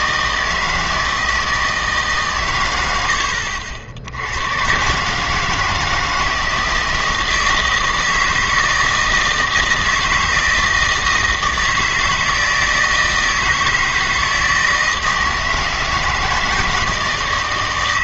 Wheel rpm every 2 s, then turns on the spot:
160, 110, 110, 160, 160, 160, 160, 160, 160.
none